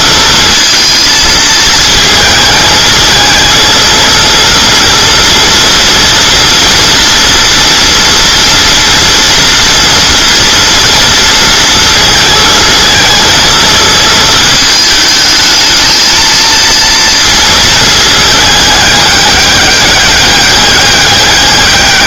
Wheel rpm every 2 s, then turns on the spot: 220, 220, 230, 230, 230, 230, 220, 220, 230, 210, 200.
none